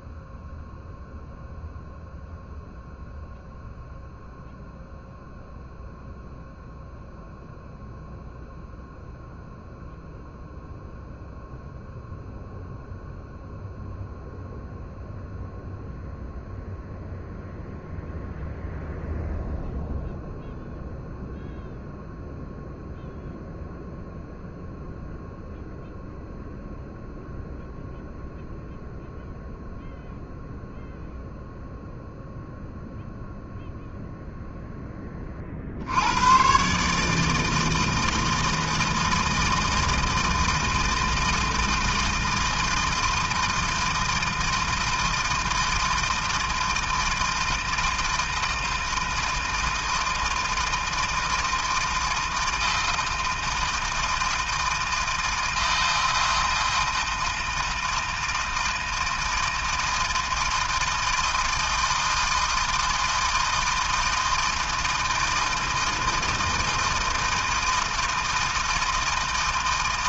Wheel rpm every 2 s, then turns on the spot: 0, 0, 0, 0, 0, 0, 0, 0, 0, 0, 0, 0, 0, 0, 0, 0, 0, 0, 130, 160, 160, 160, 160, 160, 160, 160, 160, 160, 160, 160, 160, 160, 160, 160, 160.
none